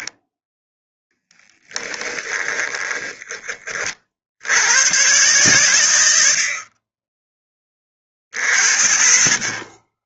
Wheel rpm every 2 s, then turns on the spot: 0, 20, 80, 20, 40.
2-4